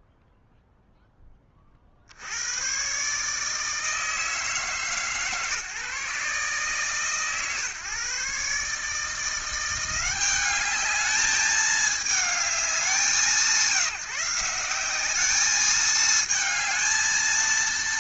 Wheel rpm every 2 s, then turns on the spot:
0, 70, 160, 140, 140, 190, 210, 180, 220.
none